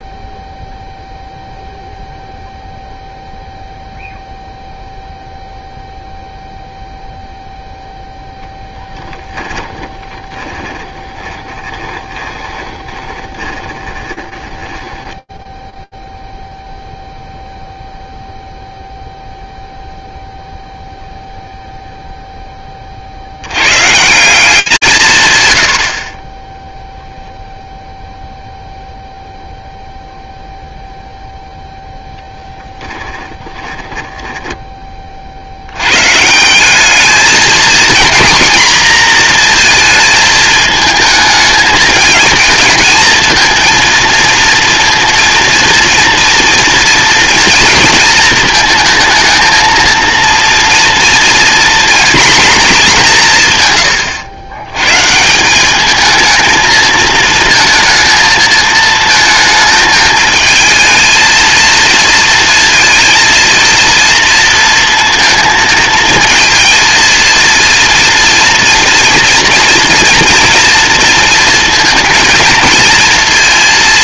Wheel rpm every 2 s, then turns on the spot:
0, 0, 0, 0, 10, 10, 20, 20, 0, 0, 0, 20, 180, 10, 0, 0, 10, 50, 220, 230, 220, 230, 230, 230, 230, 230, 170, 150, 230, 220, 230, 230, 230, 230, 230, 230, 230.
8-16 32-34